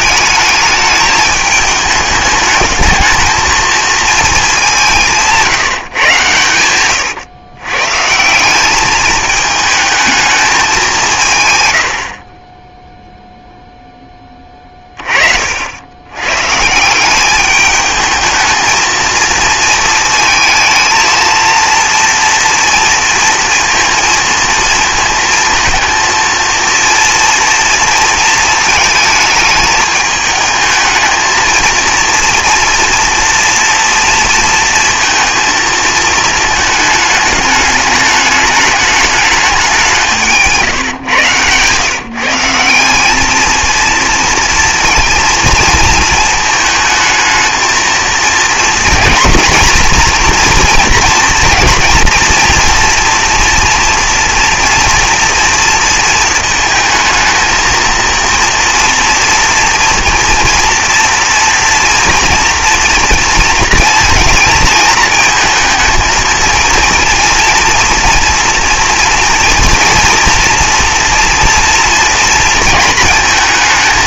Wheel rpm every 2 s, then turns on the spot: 210, 210, 200, 110, 200, 200, 10, 30, 150, 220, 220, 230, 230, 230, 220, 220, 230, 230, 220, 210, 140, 170, 230, 220, 230, 230, 230, 230, 230, 230, 240, 230, 220, 230, 230, 230, 220.
6-8 40-42